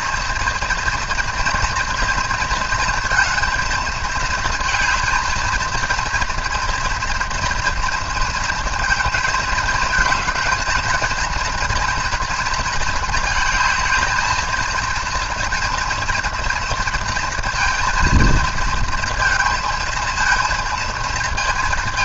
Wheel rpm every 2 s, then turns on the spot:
240, 230, 220, 230, 230, 220, 230, 220, 230, 230, 230.
none